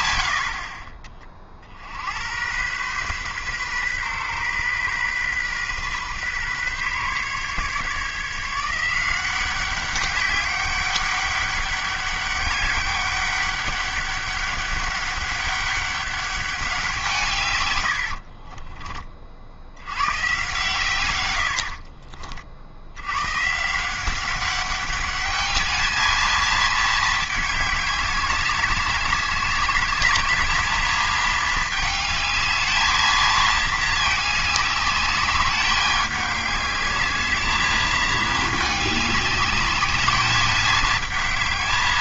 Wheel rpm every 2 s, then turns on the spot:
60, 110, 130, 130, 160, 200, 200, 200, 190, 40, 120, 50, 190, 220, 200, 210, 220, 210, 210, 210, 210.
18-20